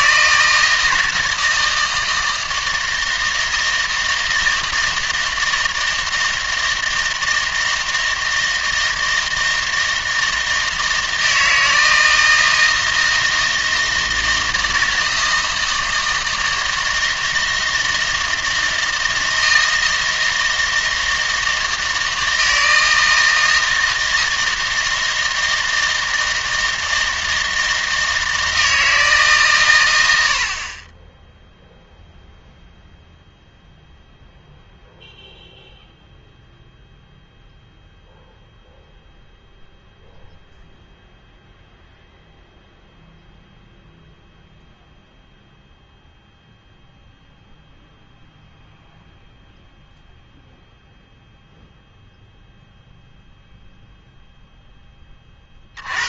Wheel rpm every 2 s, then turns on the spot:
160, 160, 160, 160, 160, 160, 160, 160, 160, 160, 160, 160, 160, 160, 160, 30, 0, 0, 0, 0, 0, 0, 0, 0, 0, 0, 0, 0.
none